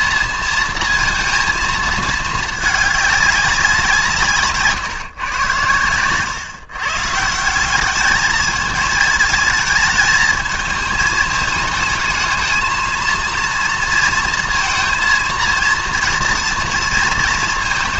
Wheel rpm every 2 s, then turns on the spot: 230, 210, 150, 130, 220, 220, 220, 230, 230.
none